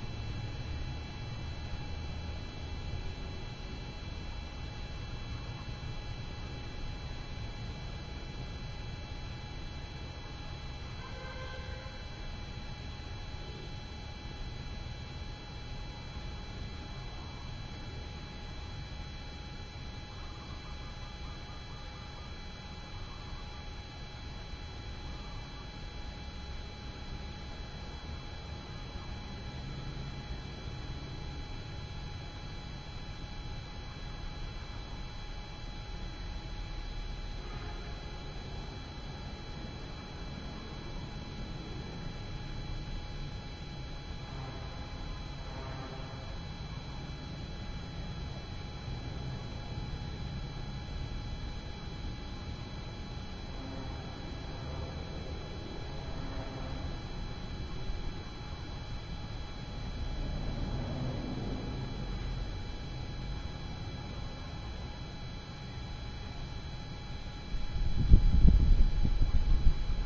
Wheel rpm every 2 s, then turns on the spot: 0, 0, 0, 0, 0, 0, 0, 0, 0, 0, 0, 0, 0, 0, 0, 0, 0, 0, 0, 0, 0, 0, 0, 0, 0, 0, 0, 0, 0, 0, 0, 0, 0, 0, 0.
none